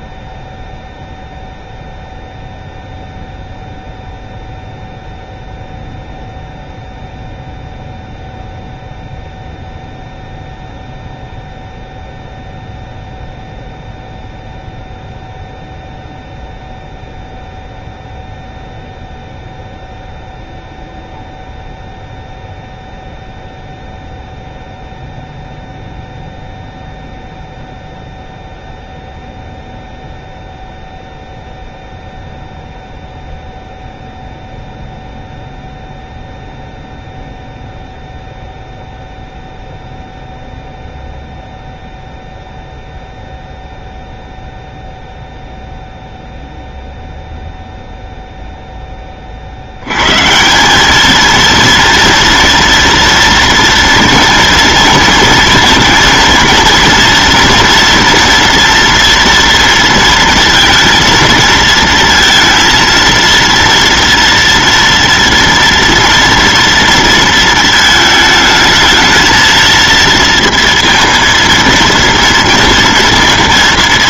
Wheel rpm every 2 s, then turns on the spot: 0, 0, 0, 0, 0, 0, 0, 0, 0, 0, 0, 0, 0, 0, 0, 0, 0, 0, 0, 0, 0, 0, 0, 0, 0, 180, 230, 230, 230, 240, 230, 230, 230, 230, 220, 230, 230.
none